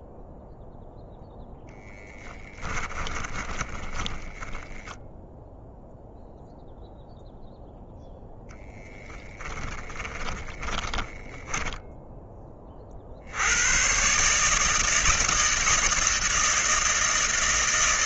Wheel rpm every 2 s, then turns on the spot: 0, 20, 20, 0, 10, 20, 50, 160, 160.
2-6 8-12